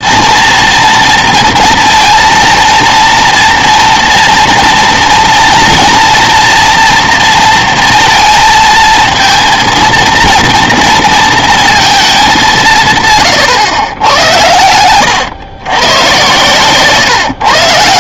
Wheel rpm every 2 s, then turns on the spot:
230, 230, 230, 230, 230, 230, 130, 120, 140.
14-18